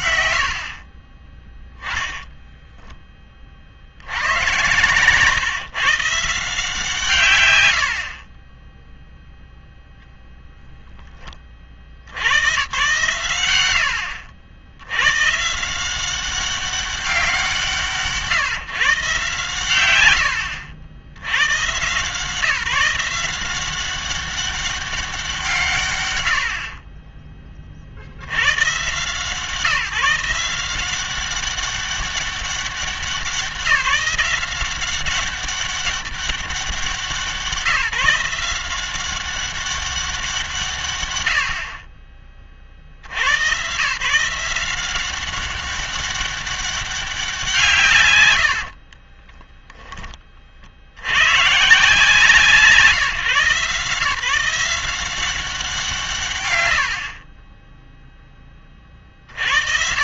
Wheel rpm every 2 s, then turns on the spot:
60, 0, 120, 160, 10, 0, 110, 80, 190, 150, 70, 170, 200, 50, 120, 170, 190, 190, 190, 180, 160, 50, 180, 200, 100, 50, 160, 180, 50, 30.
56-58